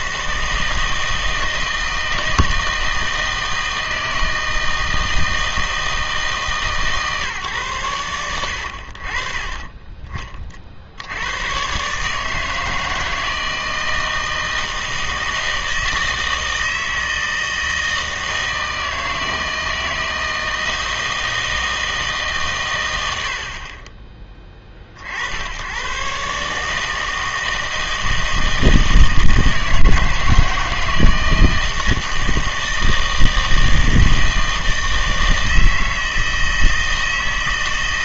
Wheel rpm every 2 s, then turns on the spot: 160, 160, 160, 150, 90, 40, 160, 160, 160, 160, 160, 130, 40, 150, 160, 160, 160, 160, 160.
none